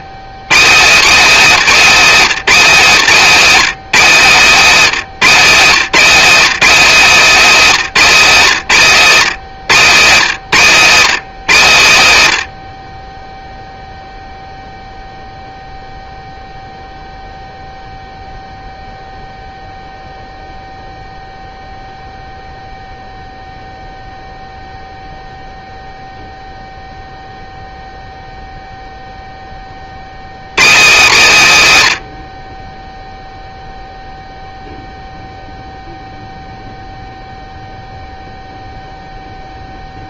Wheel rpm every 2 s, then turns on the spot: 160, 170, 150, 210, 150, 140, 50, 0, 0, 0, 0, 0, 0, 0, 0, 150, 0, 0, 0, 0.
none